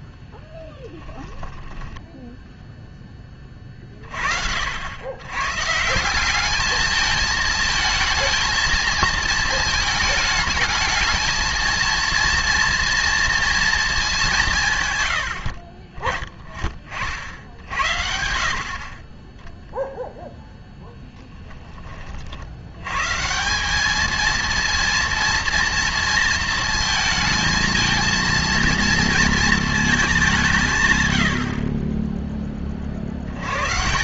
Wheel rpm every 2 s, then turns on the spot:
10, 0, 80, 220, 230, 220, 230, 130, 40, 40, 0, 110, 230, 230, 230, 120, 40.
none